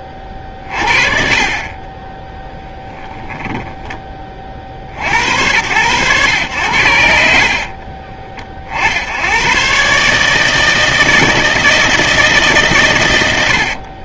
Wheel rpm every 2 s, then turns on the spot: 30, 20, 20, 100, 60, 150, 140.
2-4 12-14